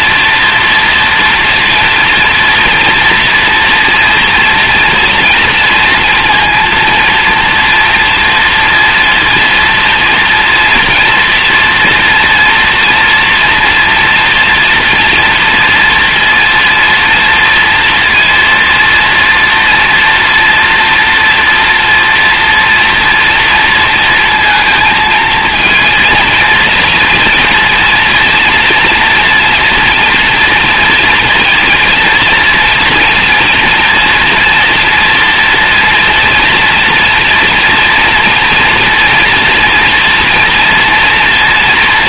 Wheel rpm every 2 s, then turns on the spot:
230, 230, 230, 230, 230, 230, 230, 240, 230, 230, 230, 230, 230, 230, 230, 230, 230, 240, 240, 240, 240.
none